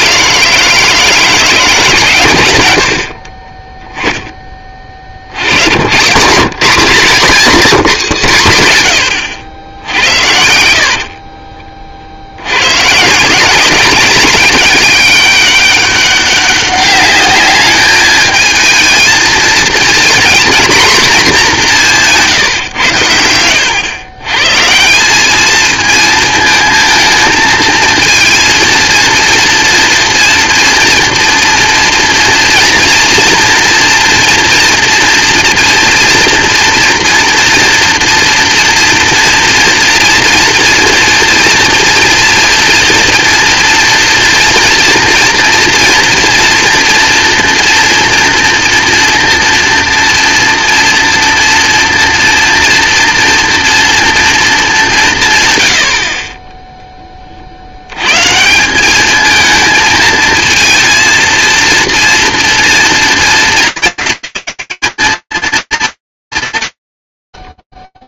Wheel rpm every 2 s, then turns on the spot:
160, 70, 60, 200, 130, 60, 130, 190, 200, 220, 240, 100, 180, 220, 230, 230, 230, 230, 240, 230, 230, 240, 240, 240, 230, 230, 230, 180, 10, 200, 230, 230, 210, 110.
10-12